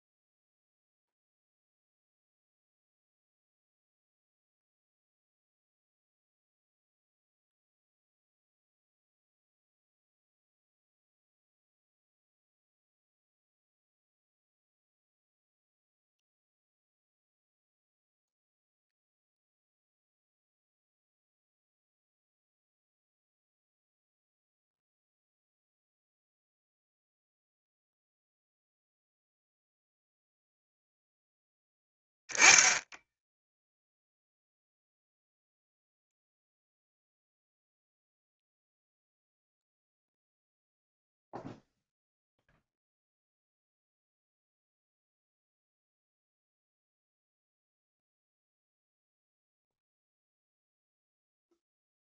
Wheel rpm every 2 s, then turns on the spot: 0, 0, 0, 0, 0, 0, 0, 0, 0, 0, 0, 0, 0, 0, 0, 0, 0, 0, 0, 0, 0, 0, 0, 0, 0, 0.
none